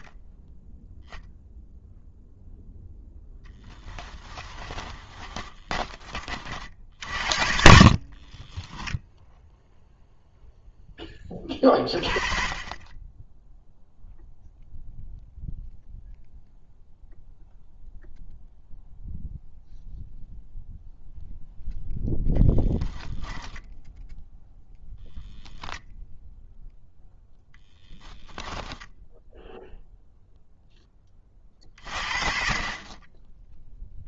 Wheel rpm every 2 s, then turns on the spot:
0, 0, 20, 50, 0, 10, 10, 0, 0, 0, 0, 10, 0, 0, 0, 30, 30.
4-6 22-24